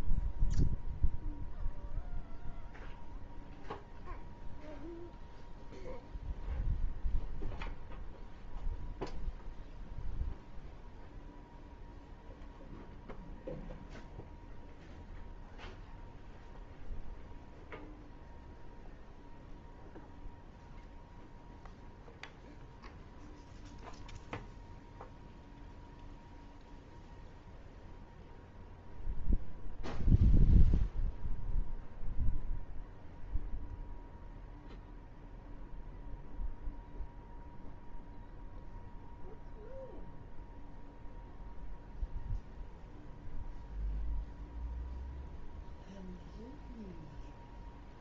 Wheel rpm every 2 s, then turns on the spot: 0, 0, 0, 0, 0, 0, 0, 0, 0, 0, 0, 0, 0, 0, 0, 0, 0, 0, 0, 0, 0, 0, 0, 0.
none